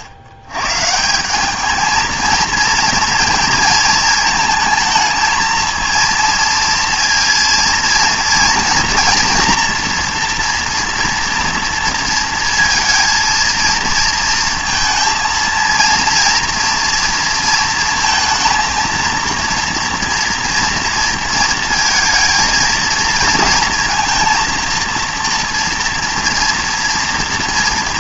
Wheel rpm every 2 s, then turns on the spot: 110, 230, 220, 230, 230, 240, 230, 230, 230, 230, 230, 220, 230, 230.
none